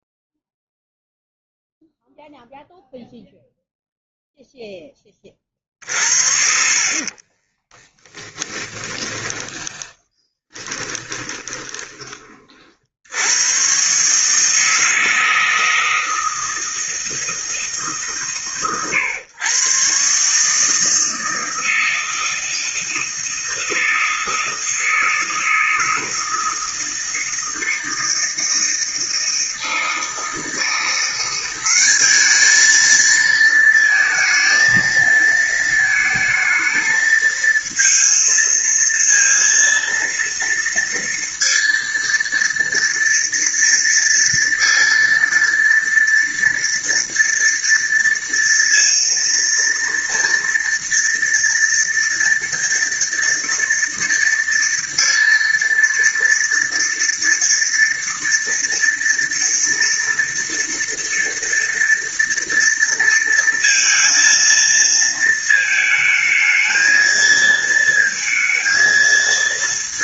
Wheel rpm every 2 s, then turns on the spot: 0, 0, 0, 50, 20, 40, 30, 150, 160, 130, 140, 160, 160, 160, 160, 160, 210, 220, 220, 230, 230, 230, 230, 230, 230, 230, 230, 230, 230, 230, 230, 230, 230, 220, 230.
8-12